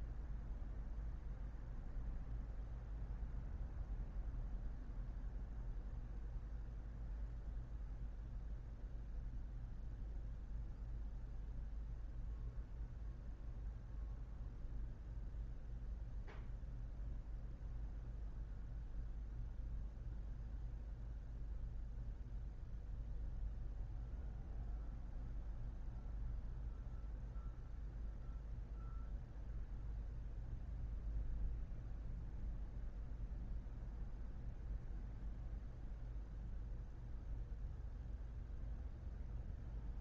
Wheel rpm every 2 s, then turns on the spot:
0, 0, 0, 0, 0, 0, 0, 0, 0, 0, 0, 0, 0, 0, 0, 0, 0, 0, 0, 0.
none